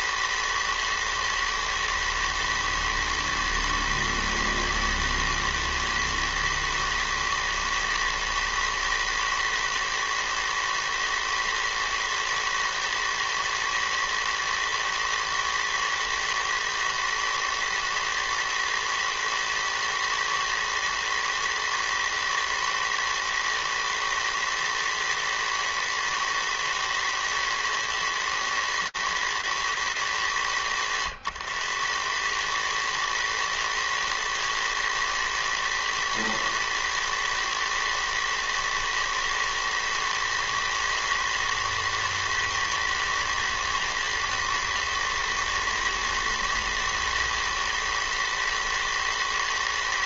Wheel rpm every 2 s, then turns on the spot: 120, 110, 110, 120, 110, 120, 110, 110, 110, 120, 110, 110, 110, 120, 110, 90, 110, 110, 110, 110, 110, 110, 110, 110, 110.
none